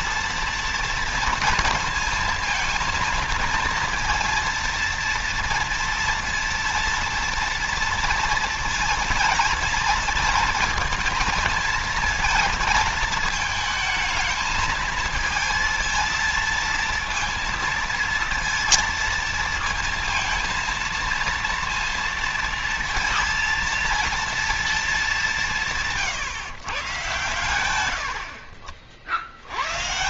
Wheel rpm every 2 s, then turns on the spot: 230, 230, 230, 230, 230, 220, 220, 220, 230, 230, 230, 230, 210, 140, 70.
none